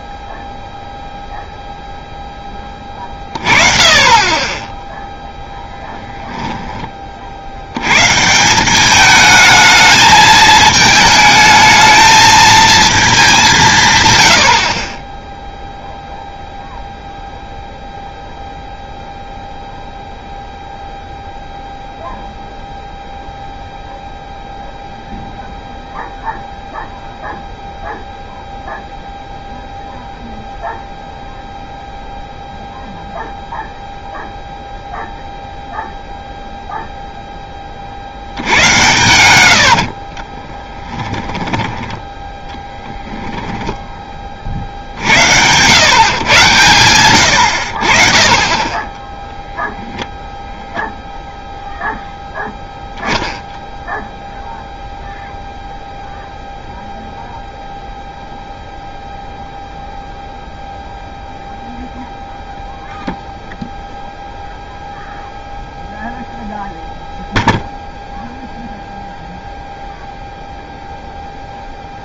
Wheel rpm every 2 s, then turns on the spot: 0, 20, 20, 10, 170, 220, 220, 60, 0, 0, 0, 0, 0, 0, 0, 0, 0, 0, 0, 90, 20, 10, 50, 110, 20, 10, 0, 0, 0, 0, 0, 0, 0, 0, 0, 0.
38-42